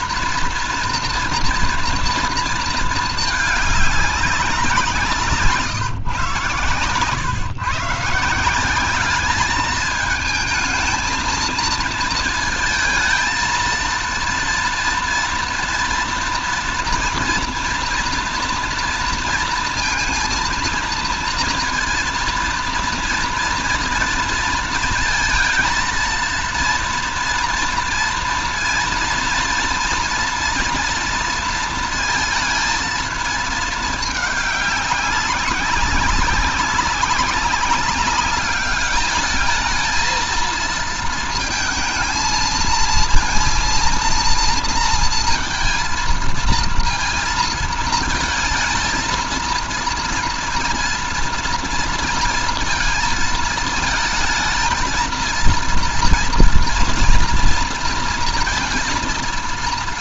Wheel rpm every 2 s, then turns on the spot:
230, 230, 190, 130, 180, 220, 230, 230, 230, 230, 230, 230, 230, 230, 230, 240, 220, 200, 200, 200, 230, 230, 230, 230, 230, 230, 220, 230, 230, 230.
none